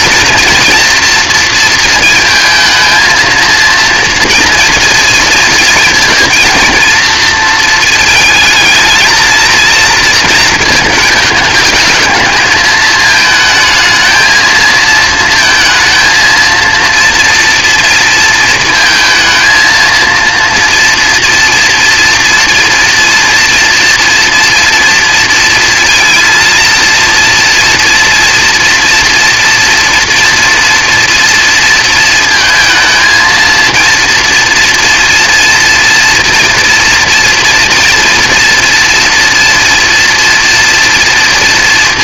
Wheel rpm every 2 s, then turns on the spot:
230, 220, 230, 230, 220, 230, 220, 230, 230, 230, 230, 230, 230, 230, 230, 230, 230, 230, 230, 230, 230.
none